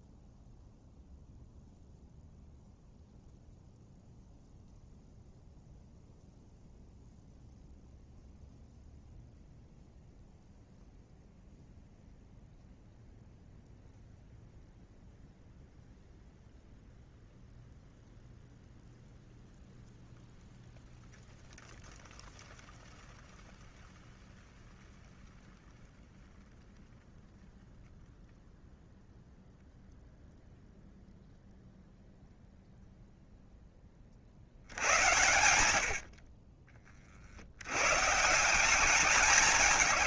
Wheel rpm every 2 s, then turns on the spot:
0, 0, 0, 0, 0, 0, 0, 0, 0, 0, 0, 0, 0, 0, 0, 0, 0, 100, 50, 190.
none